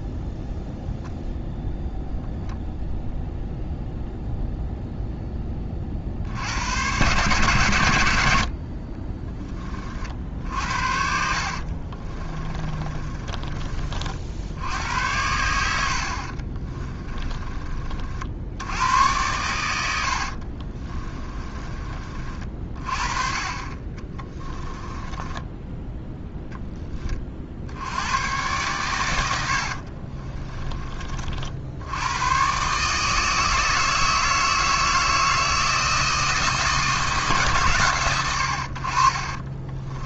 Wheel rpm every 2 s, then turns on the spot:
0, 0, 0, 100, 40, 60, 30, 90, 30, 90, 30, 30, 10, 20, 110, 30, 140, 160, 160, 50.
10-14 16-18 20-22 24-26